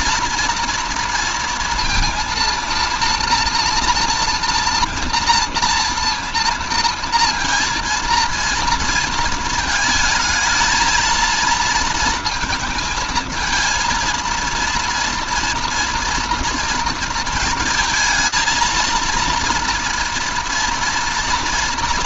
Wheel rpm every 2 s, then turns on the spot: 240, 230, 240, 230, 230, 220, 230, 230, 240, 230, 230.
none